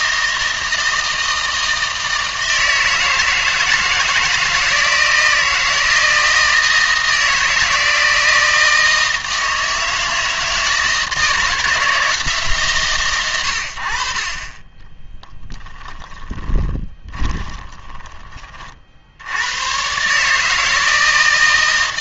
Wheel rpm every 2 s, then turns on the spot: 160, 160, 160, 160, 160, 160, 140, 30, 10, 40, 160.
16-18